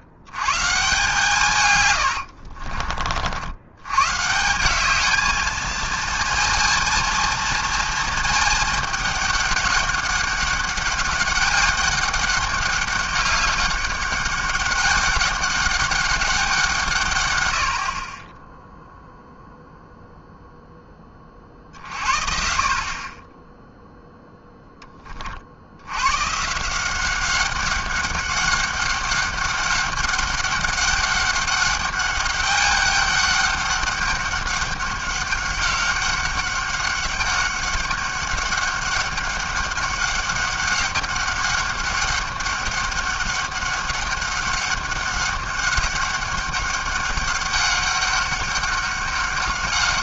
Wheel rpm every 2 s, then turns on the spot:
130, 60, 170, 230, 220, 200, 200, 200, 170, 10, 0, 50, 10, 150, 200, 200, 200, 200, 200, 200, 200, 200, 200, 200, 200.
2-4